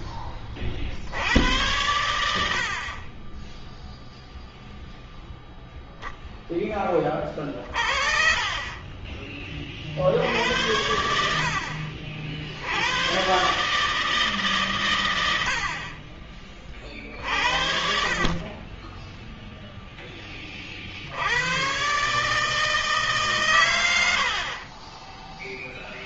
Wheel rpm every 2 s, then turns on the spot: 20, 100, 0, 0, 30, 60, 50, 150, 40, 60, 10, 140, 70.
24-26